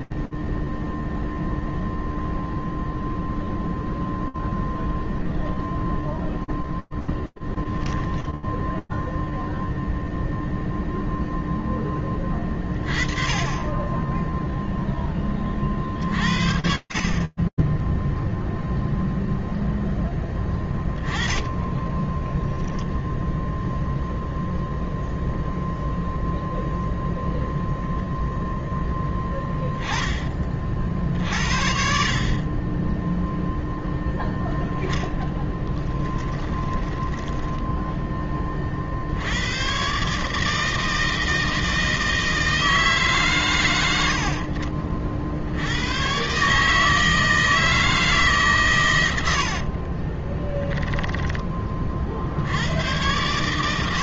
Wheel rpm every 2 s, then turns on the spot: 0, 0, 0, 0, 0, 0, 10, 30, 20, 0, 20, 0, 0, 0, 10, 60, 0, 10, 10, 90, 160, 100, 70, 160, 80, 20, 120.
34-38 48-50